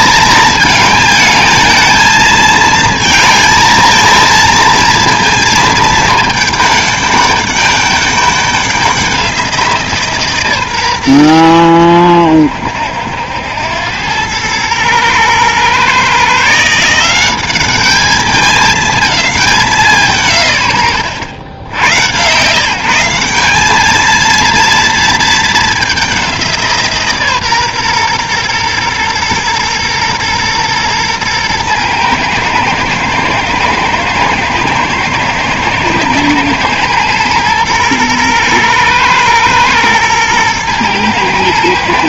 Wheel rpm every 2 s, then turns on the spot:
220, 220, 230, 210, 200, 130, 90, 110, 160, 210, 120, 160, 230, 170, 120, 120, 110, 120, 120, 120, 120.
none